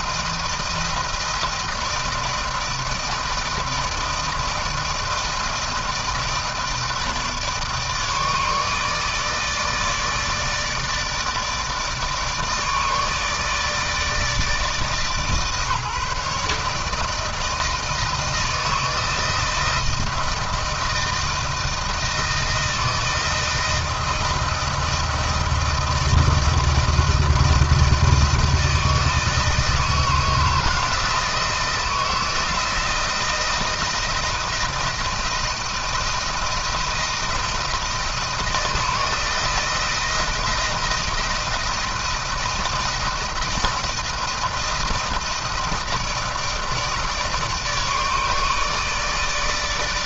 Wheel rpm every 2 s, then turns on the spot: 160, 160, 160, 160, 150, 160, 150, 160, 160, 160, 160, 160, 170, 160, 160, 160, 160, 160, 170, 160, 160, 170, 170, 160, 160.
none